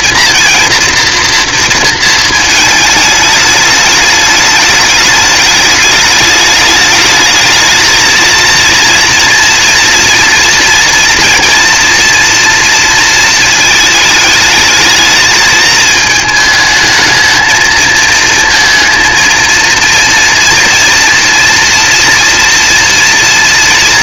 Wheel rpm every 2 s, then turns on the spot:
230, 220, 210, 210, 230, 230, 230, 220, 220, 230, 230, 230.
none